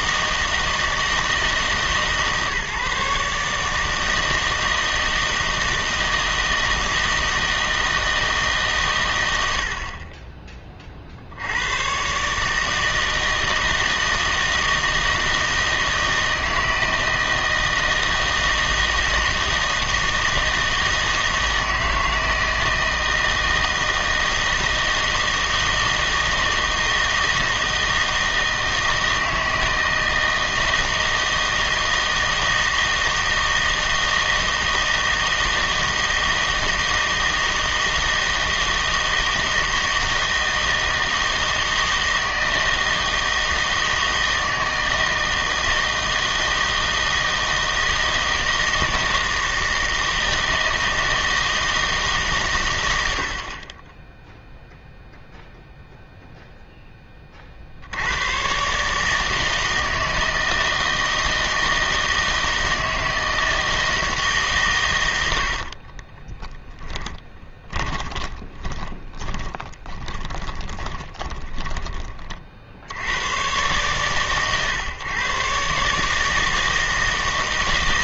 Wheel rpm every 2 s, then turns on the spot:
160, 150, 160, 160, 140, 30, 150, 160, 160, 160, 160, 160, 160, 160, 160, 160, 160, 160, 160, 160, 160, 160, 160, 160, 160, 160, 130, 0, 0, 130, 160, 160, 130, 10, 20, 20, 50, 130, 160.
66-72